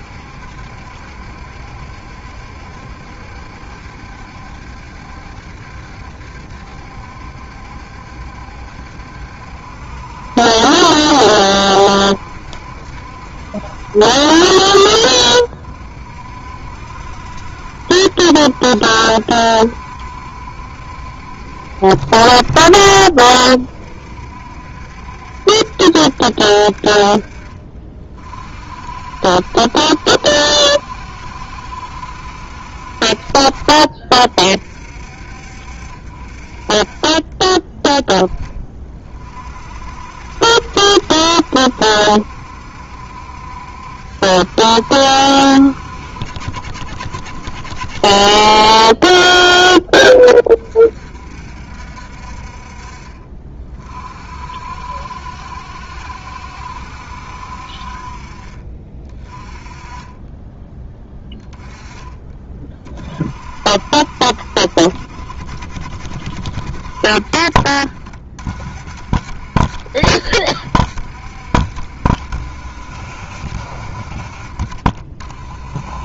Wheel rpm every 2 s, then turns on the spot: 70, 70, 70, 70, 70, 70, 70, 60, 60, 70, 70, 40, 60, 60, 50, 70, 60, 50, 40, 30, 60, 60, 70, 60, 30, 30, 50, 60, 70, 40, 10, 20, 50, 60, 50, 70, 60, 50.
22-24